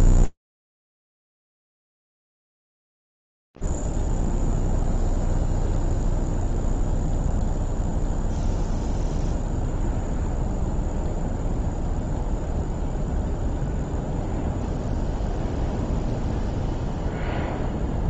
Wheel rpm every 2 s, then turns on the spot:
0, 0, 0, 0, 0, 0, 0, 0, 0.
none